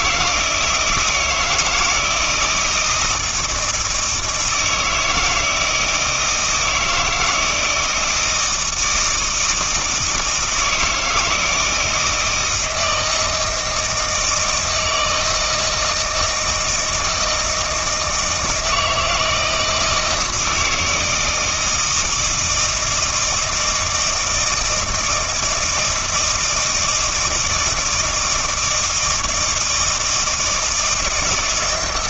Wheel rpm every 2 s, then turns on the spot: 160, 160, 160, 160, 160, 160, 160, 160, 160, 160, 160, 160, 160, 160, 160, 160.
none